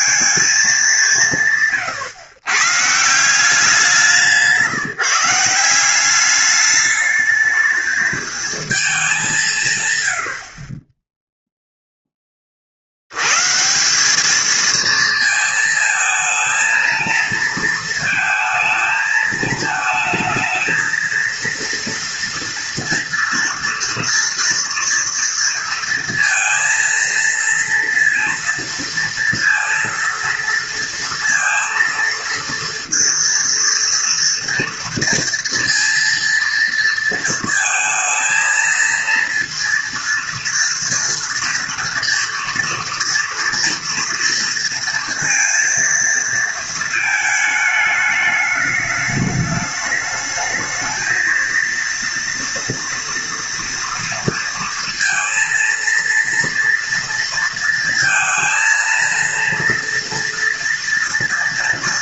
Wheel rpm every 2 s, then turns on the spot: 200, 140, 150, 210, 220, 40, 60, 220, 220, 220, 230, 230, 230, 230, 230, 230, 230, 230, 230, 230, 230, 230, 230, 220, 210, 220, 240, 230, 230, 230, 230.
none